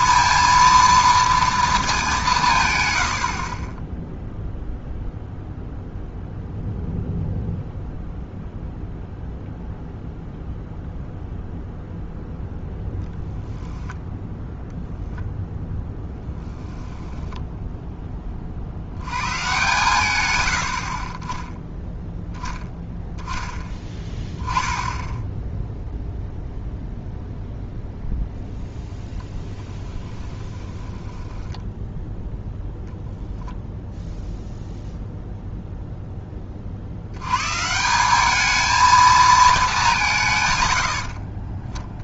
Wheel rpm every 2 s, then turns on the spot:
230, 120, 0, 0, 0, 0, 0, 0, 10, 70, 60, 10, 10, 0, 0, 10, 0, 0, 40, 220, 80.
2-4 16-18 30-32